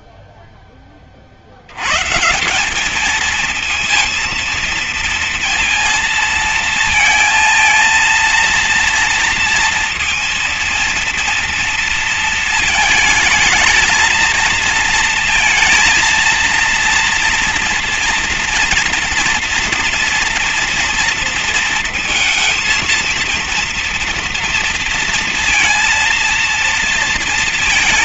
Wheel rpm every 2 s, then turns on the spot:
10, 180, 230, 230, 230, 230, 220, 230, 230, 230, 230, 230, 230, 230.
none